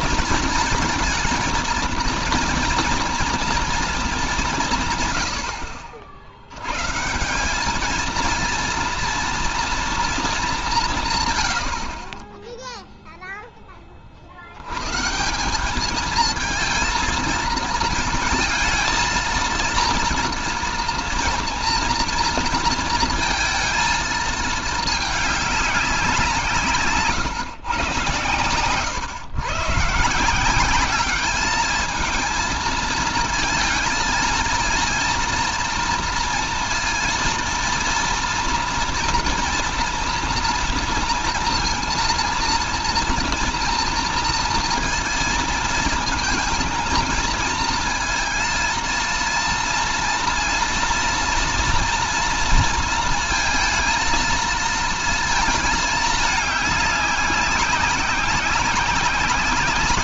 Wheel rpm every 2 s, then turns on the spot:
230, 230, 160, 130, 230, 180, 0, 100, 230, 230, 230, 230, 210, 160, 120, 190, 230, 230, 230, 230, 230, 230, 230, 230, 230, 230, 230, 220, 200, 190.
none